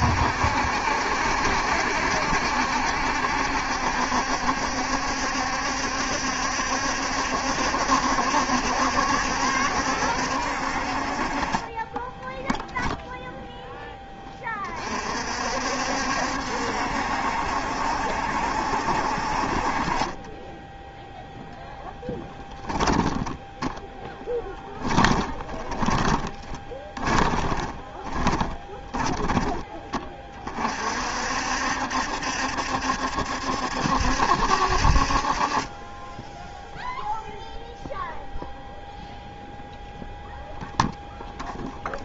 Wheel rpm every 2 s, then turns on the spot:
70, 70, 70, 70, 70, 60, 0, 30, 70, 60, 10, 10, 10, 20, 10, 40, 70, 70, 0, 0, 0.
24-30